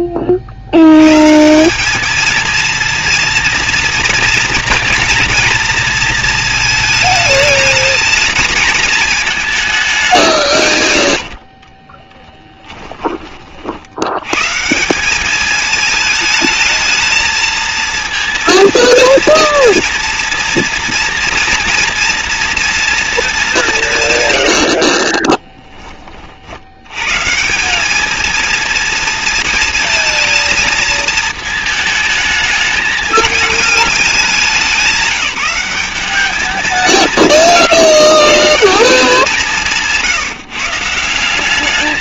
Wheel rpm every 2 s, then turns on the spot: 80, 230, 230, 220, 220, 110, 30, 190, 220, 230, 230, 230, 20, 150, 230, 220, 220, 190, 170, 170, 180.
24-26